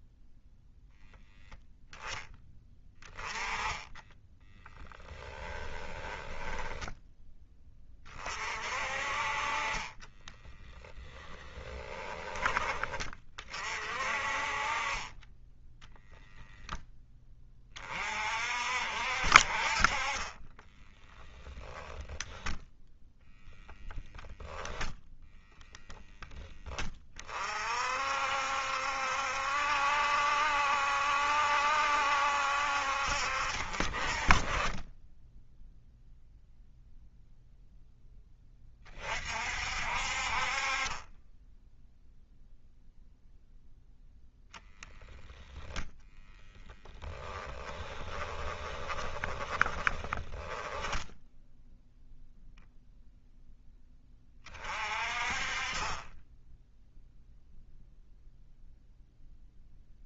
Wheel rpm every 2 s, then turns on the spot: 0, 10, 10, 10, 40, 10, 30, 30, 10, 50, 10, 0, 0, 30, 70, 70, 60, 10, 0, 30, 20, 0, 10, 10, 20, 10, 0, 30, 0, 0.
2-6 10-12 14-16 20-22 34-36 46-52